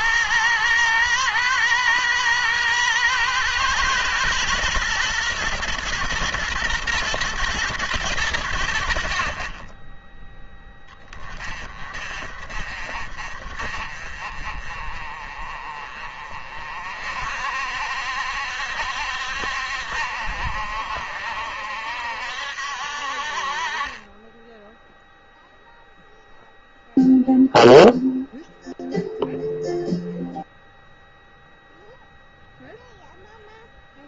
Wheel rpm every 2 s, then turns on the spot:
110, 110, 120, 120, 90, 10, 40, 40, 50, 70, 70, 60, 10, 0, 0, 0, 0.
none